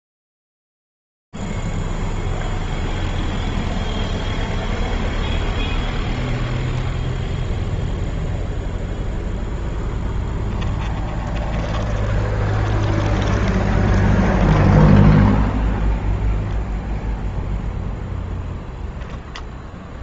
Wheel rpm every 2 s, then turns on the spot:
0, 0, 0, 10, 0, 10, 20, 10, 10, 0.
10-14